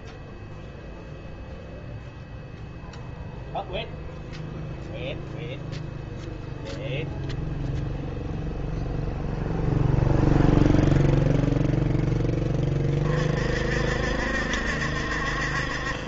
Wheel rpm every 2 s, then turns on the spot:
0, 0, 0, 0, 0, 0, 30, 60.
none